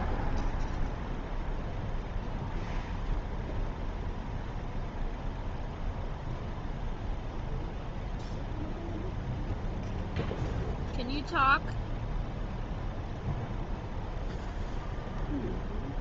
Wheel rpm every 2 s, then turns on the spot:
0, 0, 0, 0, 0, 0, 0, 0.
none